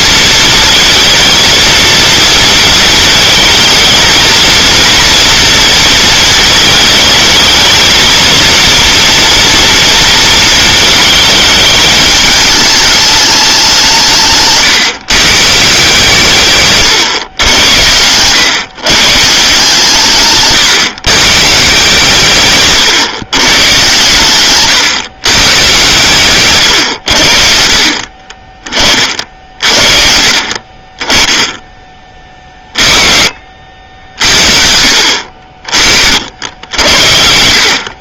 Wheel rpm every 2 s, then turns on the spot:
230, 230, 240, 220, 230, 220, 210, 130, 130, 150, 130, 120, 120, 110, 40, 30, 30, 60, 70.
26-28